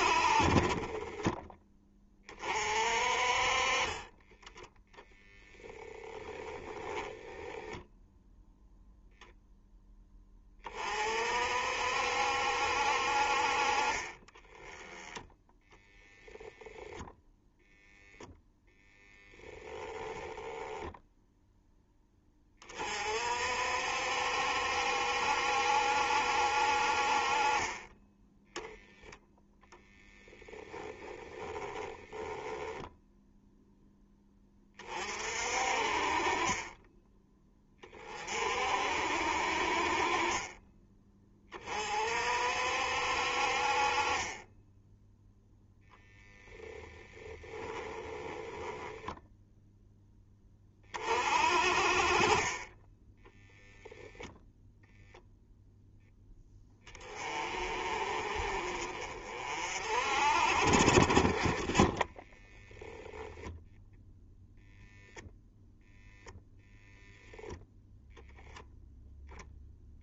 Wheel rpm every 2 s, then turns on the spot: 20, 40, 0, 10, 0, 30, 60, 20, 0, 10, 0, 30, 70, 50, 10, 20, 0, 30, 20, 50, 20, 60, 10, 10, 0, 30, 20, 0, 20, 40, 40, 10, 0, 20, 10.
6-8 30-32 46-48 62-64